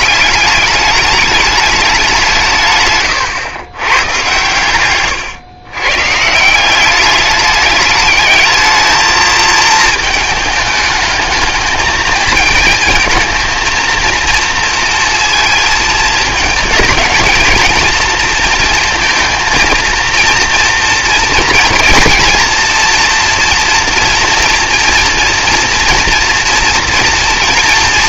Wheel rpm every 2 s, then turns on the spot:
200, 150, 120, 180, 220, 210, 220, 230, 220, 230, 230, 240, 230, 230.
4-6